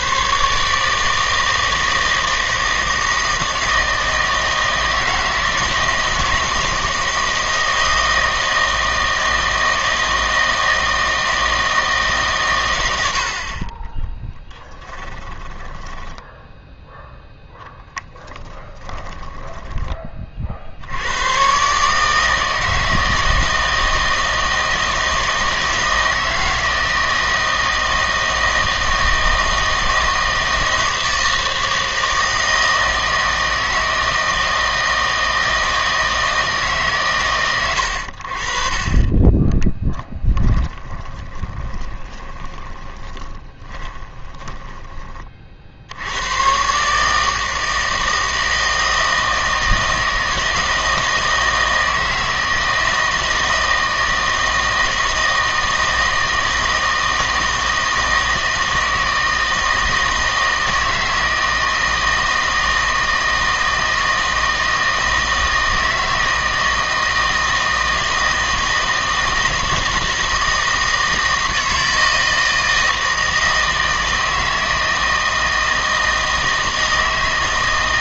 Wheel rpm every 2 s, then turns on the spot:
150, 160, 160, 160, 160, 160, 100, 10, 10, 30, 70, 160, 160, 160, 160, 160, 160, 160, 150, 40, 10, 20, 20, 140, 160, 160, 160, 160, 160, 160, 160, 160, 160, 160, 160, 160, 160, 160, 160.
14-16 18-20 40-44